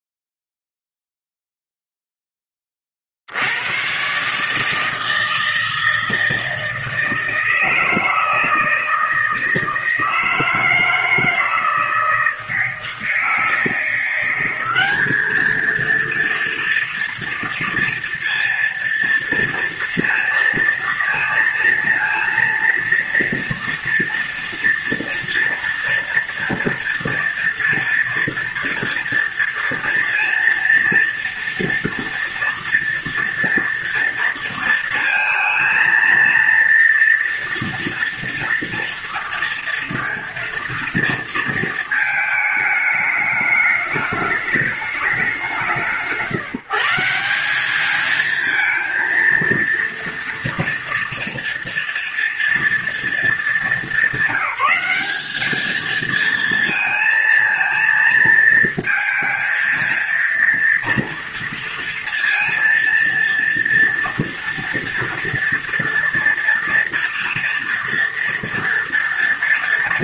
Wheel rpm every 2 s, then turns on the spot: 0, 20, 150, 160, 160, 160, 160, 190, 230, 230, 230, 230, 230, 230, 240, 230, 240, 230, 230, 230, 230, 220, 210, 170, 230, 230, 230, 200, 230, 230, 230, 230, 230, 230, 230.
none